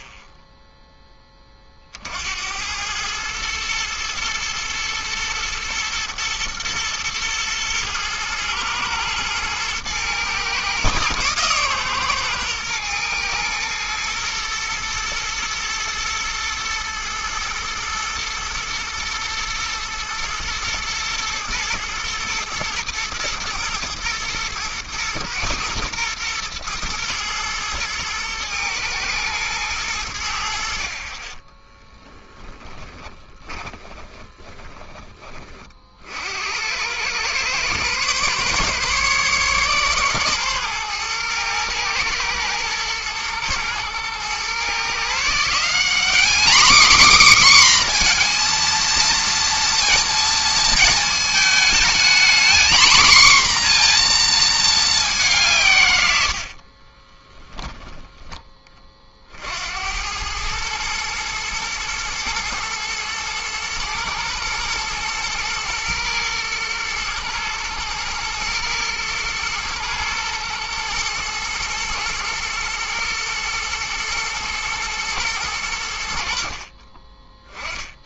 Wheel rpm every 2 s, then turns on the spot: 0, 100, 120, 120, 110, 120, 120, 120, 110, 120, 120, 120, 110, 110, 110, 50, 30, 20, 100, 140, 120, 110, 140, 260, 230, 220, 240, 210, 40, 30, 110, 120, 120, 120, 120, 110, 110, 110, 30.
32-36 56-58